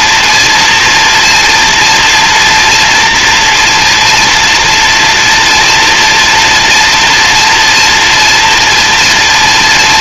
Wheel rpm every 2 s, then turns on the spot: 230, 230, 240, 230, 230.
none